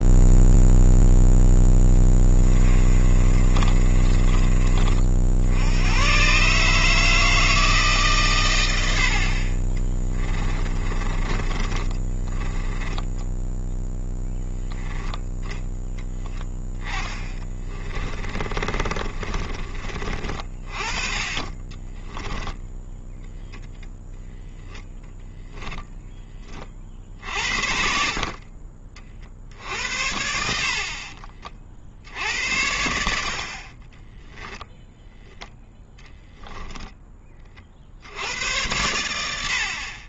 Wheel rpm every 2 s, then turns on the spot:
0, 30, 40, 150, 80, 30, 10, 20, 10, 30, 30, 10, 0, 50, 50, 60, 80, 10, 20, 100.
2-4 10-14 16-20 22-24